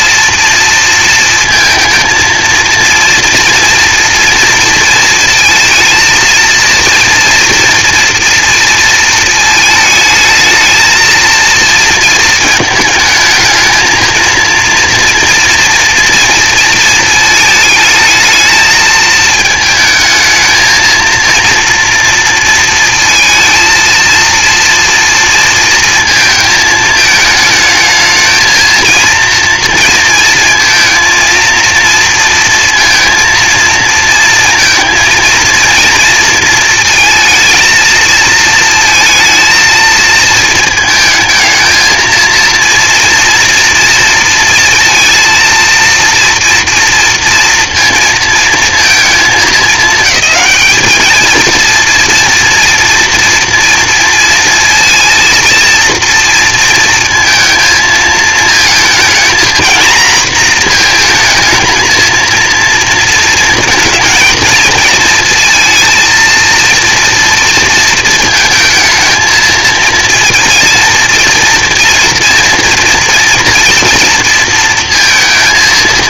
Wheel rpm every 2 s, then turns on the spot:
230, 230, 230, 230, 230, 220, 220, 230, 230, 220, 220, 230, 230, 220, 220, 230, 230, 230, 230, 230, 220, 230, 230, 230, 230, 220, 230, 230, 230, 230, 230, 230, 230, 230, 230, 230, 230, 230.
none